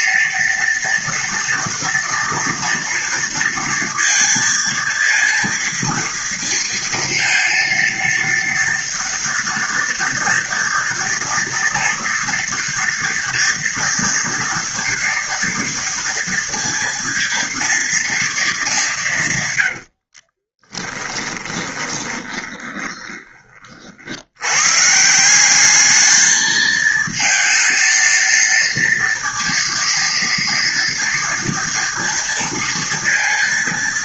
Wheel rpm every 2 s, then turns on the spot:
230, 230, 230, 230, 230, 240, 230, 230, 230, 210, 20, 20, 110, 220, 230, 230, 230.
20-24